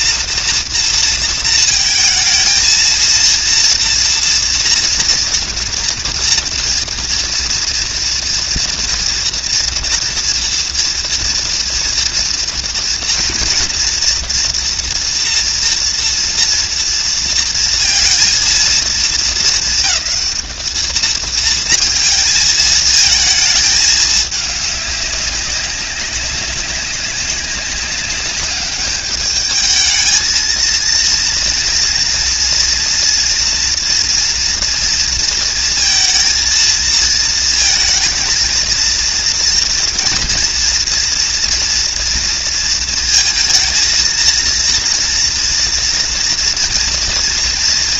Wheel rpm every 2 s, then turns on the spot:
230, 230, 230, 230, 230, 230, 240, 230, 230, 230, 220, 220, 200, 200, 210, 230, 240, 230, 220, 230, 240, 230, 230, 230.
none